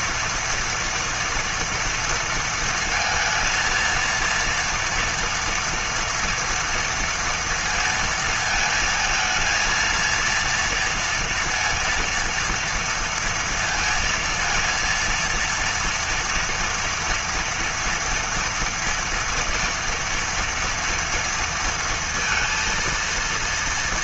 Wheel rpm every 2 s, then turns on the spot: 240, 230, 230, 230, 220, 230, 230, 230, 230, 240, 230, 230.
none